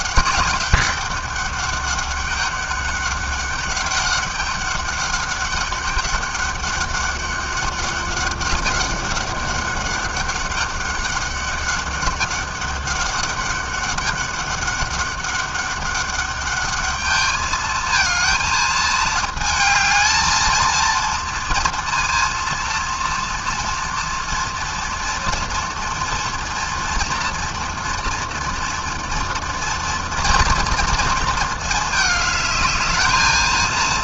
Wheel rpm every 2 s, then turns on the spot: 190, 200, 200, 200, 200, 200, 200, 200, 210, 220, 230, 230, 230, 230, 230, 220, 220.
none